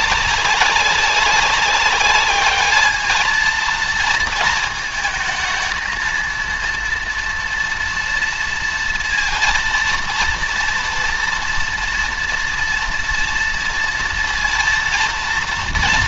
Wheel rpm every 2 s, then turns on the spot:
200, 220, 220, 230, 230, 230, 230, 230.
none